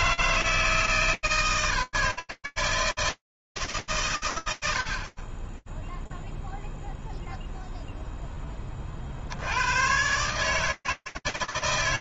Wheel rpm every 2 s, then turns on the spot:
110, 160, 100, 0, 20, 150.
none